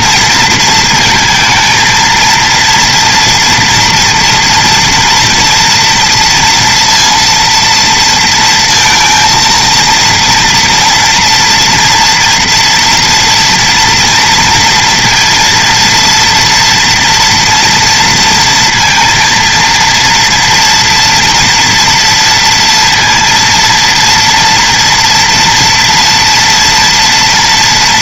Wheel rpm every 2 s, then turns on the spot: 230, 230, 230, 230, 230, 230, 240, 230, 230, 230, 230, 230, 230, 230.
none